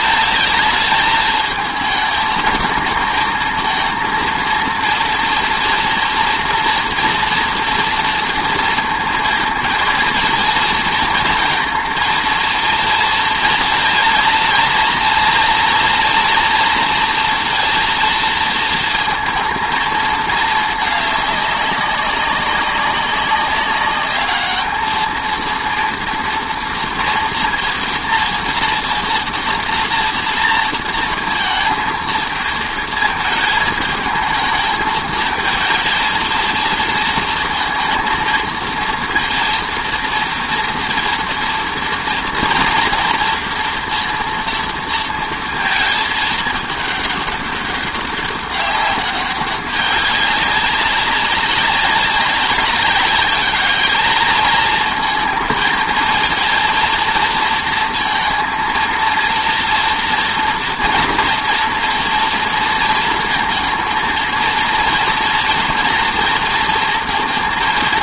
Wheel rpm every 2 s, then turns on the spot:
220, 220, 230, 240, 230, 230, 230, 230, 230, 230, 220, 200, 220, 230, 230, 230, 220, 220, 230, 230, 230, 230, 230, 210, 200, 200, 190, 220, 230, 230, 240, 230, 230, 230.
none